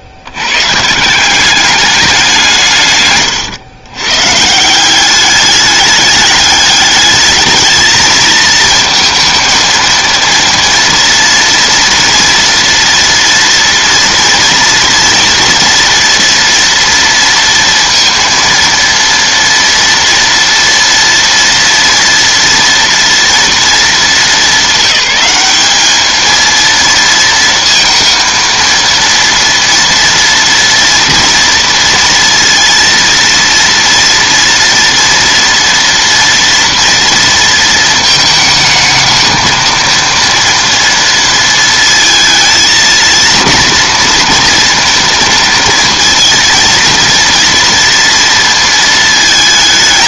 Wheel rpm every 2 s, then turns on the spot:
150, 130, 190, 210, 230, 230, 230, 230, 230, 230, 230, 230, 210, 230, 230, 230, 230, 230, 230, 220, 230, 230, 230, 230, 220.
none